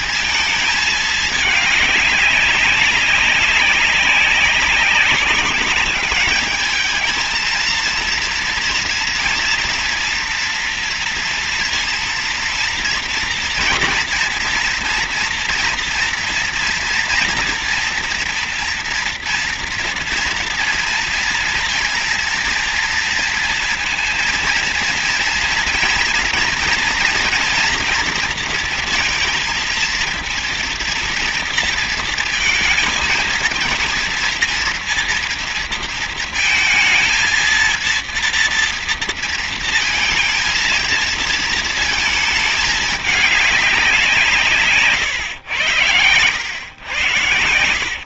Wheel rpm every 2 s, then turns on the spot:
220, 200, 190, 220, 230, 230, 230, 230, 230, 230, 230, 230, 230, 230, 230, 230, 230, 230, 230, 230, 230, 220, 160, 90.
none